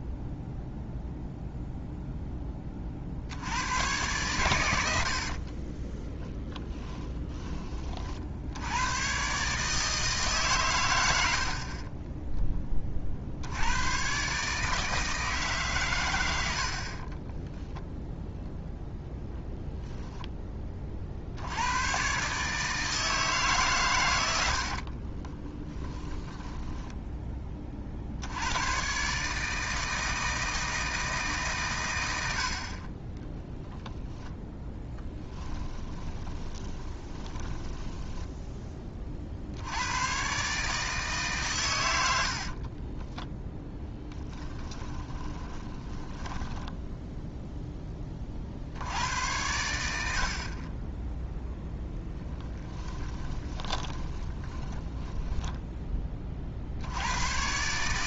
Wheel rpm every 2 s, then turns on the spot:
0, 10, 100, 10, 90, 120, 20, 150, 70, 0, 30, 150, 60, 10, 110, 160, 50, 10, 20, 10, 150, 30, 10, 10, 60, 30, 10, 10, 70.
6-8 24-28 34-38 42-46 52-56